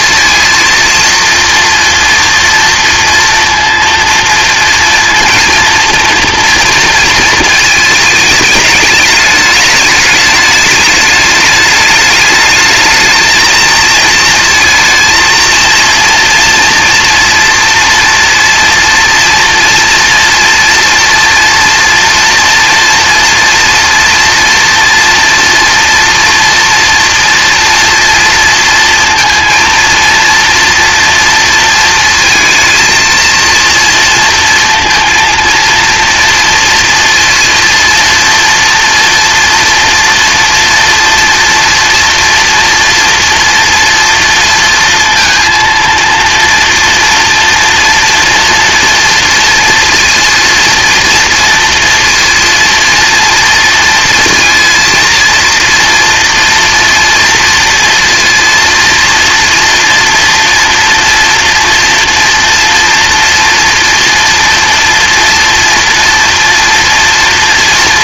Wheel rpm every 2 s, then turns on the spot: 230, 230, 230, 230, 210, 210, 220, 230, 230, 230, 230, 240, 230, 230, 230, 230, 230, 230, 230, 240, 230, 230, 230, 240, 230, 240, 230, 230, 230, 230, 230, 230, 230, 230.
none